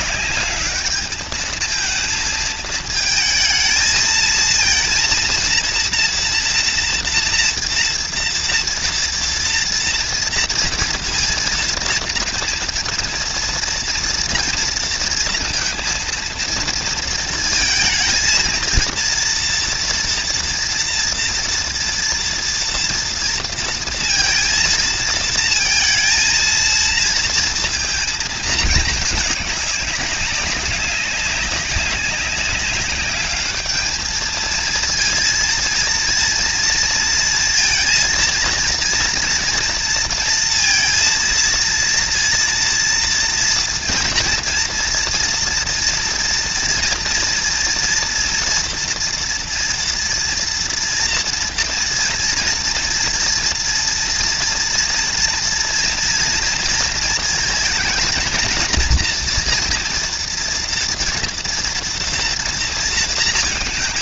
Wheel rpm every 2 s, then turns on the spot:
220, 230, 240, 230, 230, 230, 230, 230, 230, 230, 230, 230, 230, 220, 190, 190, 230, 230, 230, 230, 230, 230, 240, 230, 230, 240, 240, 230, 230, 230, 230, 230.
none